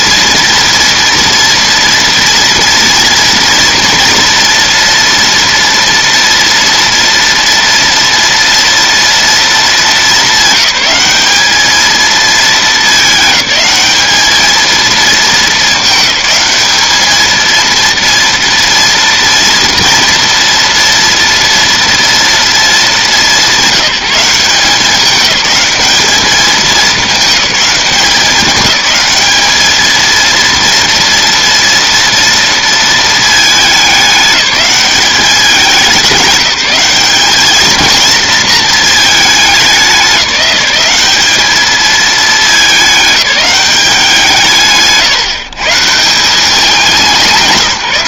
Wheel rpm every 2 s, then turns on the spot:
230, 230, 230, 230, 230, 200, 220, 220, 200, 230, 230, 220, 180, 210, 190, 230, 230, 200, 190, 220, 190, 210, 160, 200.
none